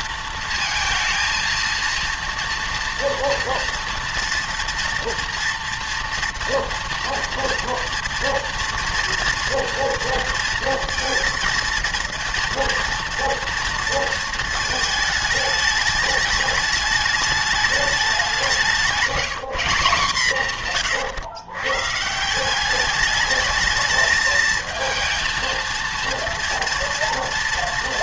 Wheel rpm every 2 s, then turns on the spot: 230, 240, 230, 230, 230, 230, 230, 220, 210, 180, 150, 200, 220, 230.
18-20